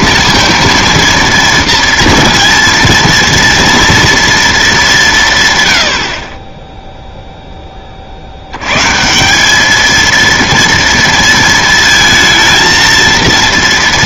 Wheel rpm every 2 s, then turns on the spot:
230, 230, 220, 10, 100, 230, 230.
none